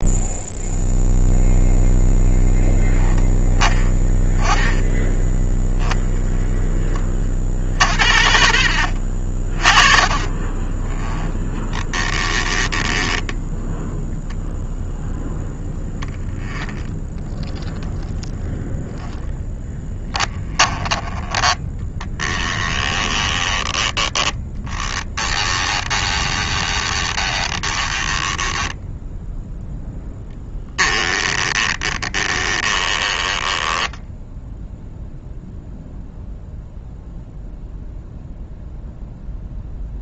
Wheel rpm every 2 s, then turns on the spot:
0, 10, 10, 20, 50, 10, 10, 10, 10, 10, 10, 20, 10, 20, 10, 10, 10, 0, 0, 0.
16-18 22-28 30-34